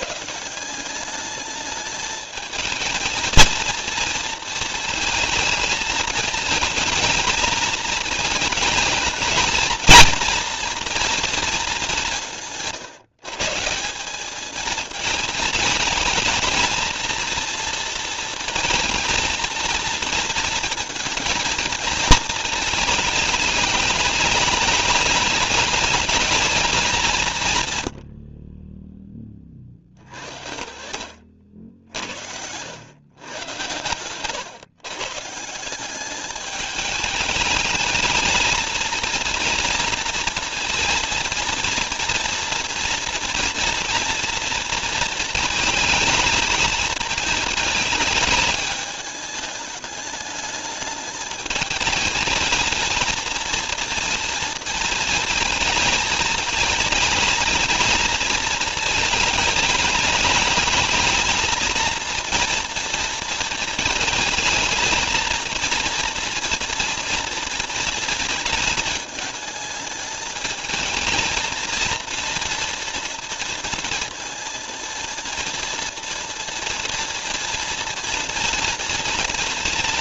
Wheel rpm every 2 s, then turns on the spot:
190, 220, 230, 220, 220, 230, 160, 220, 230, 230, 230, 220, 210, 200, 20, 70, 110, 140, 210, 220, 230, 230, 230, 220, 210, 210, 220, 230, 220, 220, 210, 230, 220, 230, 220, 220, 230, 230, 230, 230.
none